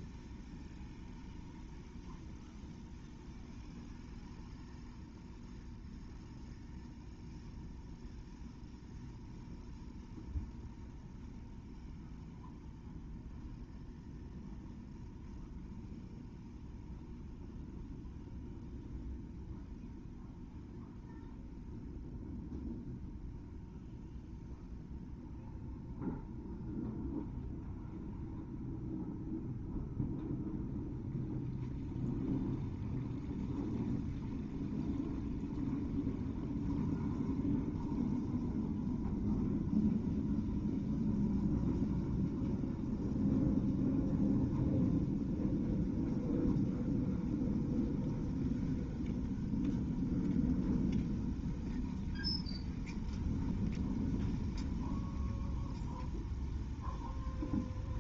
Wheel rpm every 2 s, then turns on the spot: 0, 0, 0, 0, 0, 0, 0, 0, 0, 0, 0, 0, 0, 0, 0, 0, 0, 0, 0, 0, 0, 0, 0, 0, 0, 0, 0, 0, 0.
none